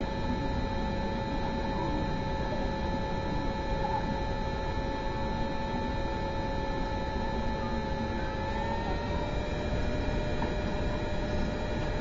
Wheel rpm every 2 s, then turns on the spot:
0, 0, 0, 0, 0, 0.
none